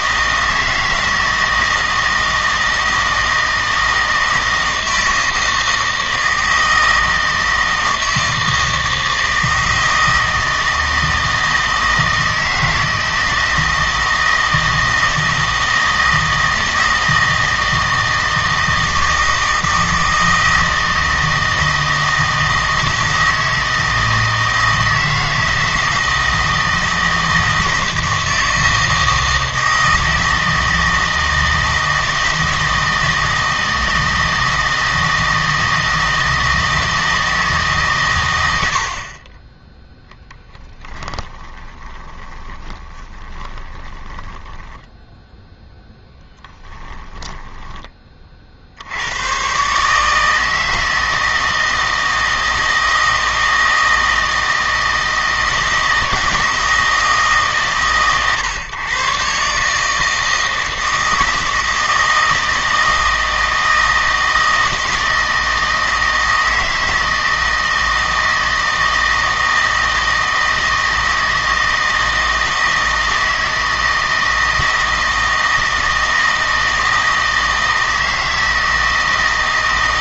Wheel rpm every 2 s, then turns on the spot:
160, 160, 160, 160, 160, 160, 160, 160, 160, 160, 160, 160, 160, 160, 160, 160, 160, 160, 160, 70, 10, 20, 10, 10, 70, 160, 160, 160, 160, 130, 160, 160, 160, 160, 160, 160, 160, 160, 160, 160.
40-48